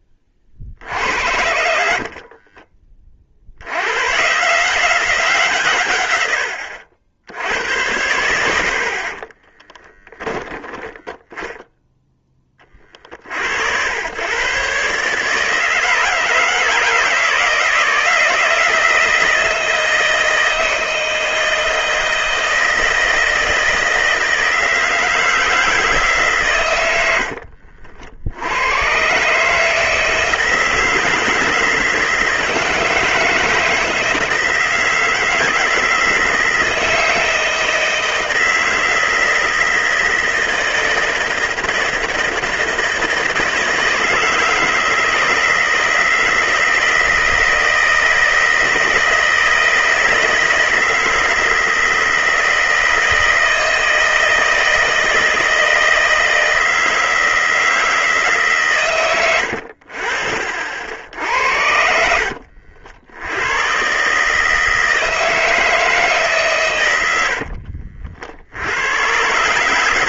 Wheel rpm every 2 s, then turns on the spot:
60, 40, 170, 70, 50, 10, 30, 140, 160, 170, 160, 160, 160, 90, 110, 160, 160, 160, 170, 160, 160, 160, 160, 160, 160, 160, 160, 160, 160, 130, 70, 60, 160, 120, 100.
0-2 10-12